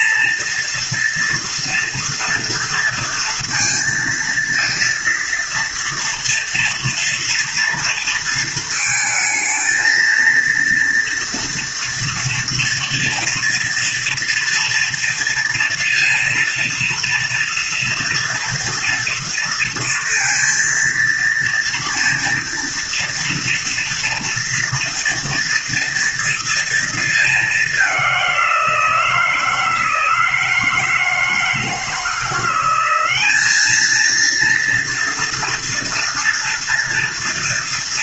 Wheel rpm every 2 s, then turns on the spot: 230, 230, 230, 230, 230, 230, 230, 230, 230, 230, 230, 230, 230, 230, 170, 160, 180, 230, 230.
none